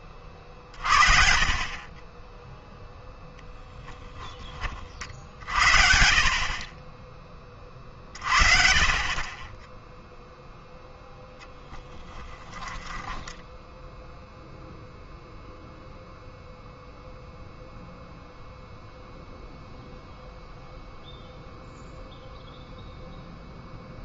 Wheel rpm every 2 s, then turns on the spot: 40, 0, 30, 40, 40, 0, 10, 0, 0, 0, 0, 0.
12-14